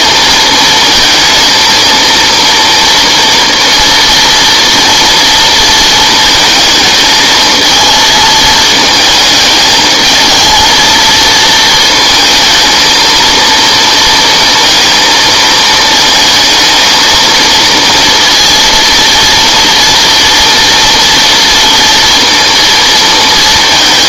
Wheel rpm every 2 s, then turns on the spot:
230, 230, 240, 220, 220, 230, 220, 230, 230, 230, 230, 230.
none